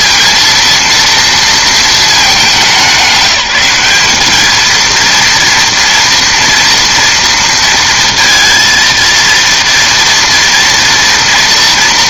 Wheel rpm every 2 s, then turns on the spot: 230, 180, 220, 230, 230, 230.
none